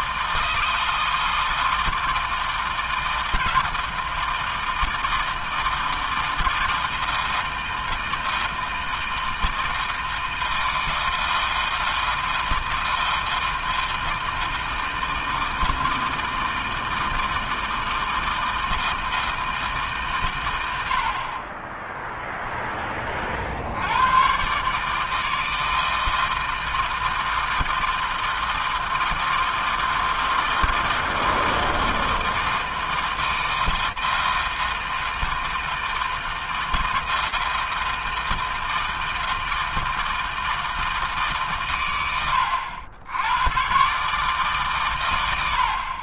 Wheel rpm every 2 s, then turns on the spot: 160, 160, 160, 160, 160, 160, 160, 160, 160, 160, 120, 0, 120, 160, 160, 160, 160, 160, 160, 160, 160, 100, 140.
none